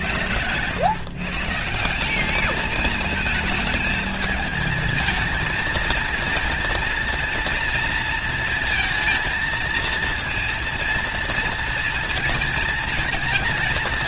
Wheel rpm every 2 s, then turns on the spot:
110, 210, 220, 230, 230, 230, 220.
none